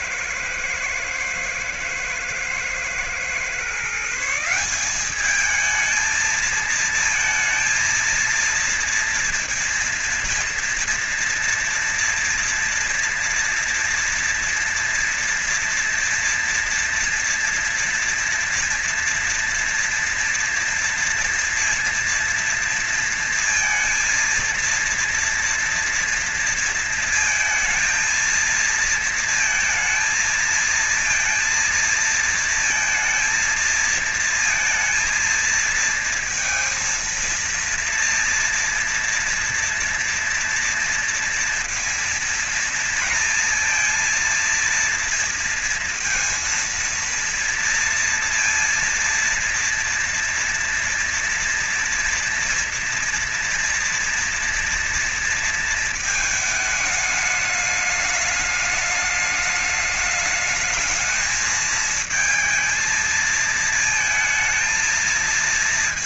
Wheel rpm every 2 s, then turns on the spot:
110, 110, 160, 220, 230, 230, 240, 240, 230, 230, 230, 230, 230, 230, 230, 230, 230, 230, 220, 230, 240, 230, 230, 230, 230, 230, 230, 230, 220, 210, 220, 220, 220.
none